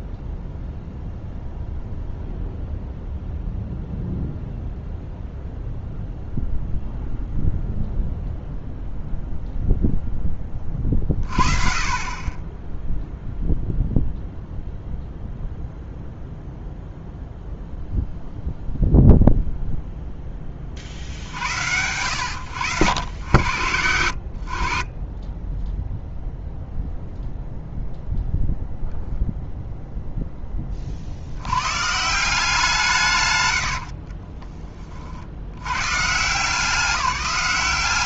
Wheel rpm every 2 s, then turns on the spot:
0, 0, 0, 0, 0, 30, 0, 0, 0, 0, 30, 80, 40, 0, 0, 50, 150, 30, 190.
none